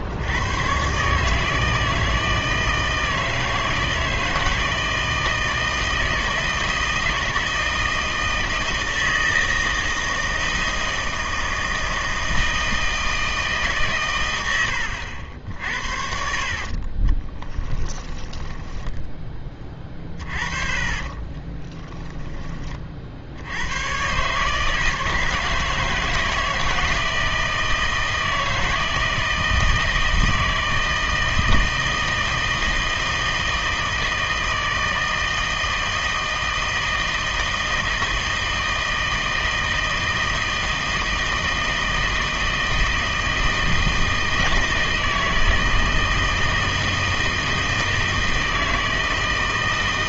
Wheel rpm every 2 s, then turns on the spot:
110, 160, 160, 160, 160, 160, 160, 90, 50, 10, 40, 30, 150, 160, 170, 160, 160, 160, 160, 160, 160, 160, 160, 160, 160.
16-22